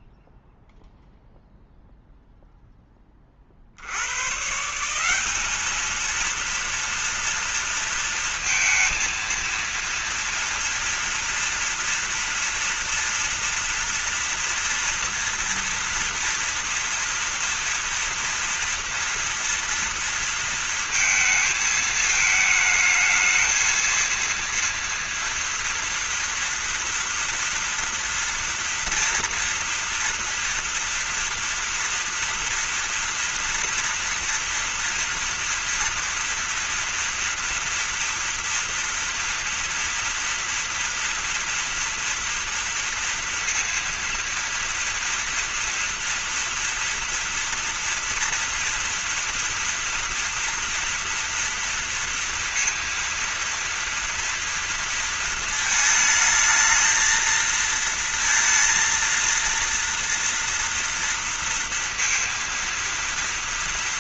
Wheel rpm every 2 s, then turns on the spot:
0, 0, 150, 230, 230, 230, 230, 230, 230, 230, 230, 220, 230, 240, 230, 230, 230, 230, 230, 230, 230, 230, 230, 230, 230, 230, 230, 230, 220, 230, 240, 230.
none